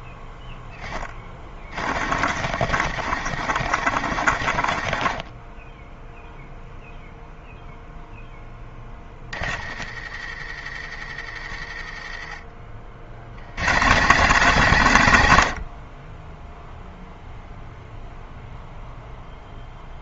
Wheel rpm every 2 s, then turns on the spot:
10, 80, 60, 0, 10, 60, 50, 130, 0, 0.
2-6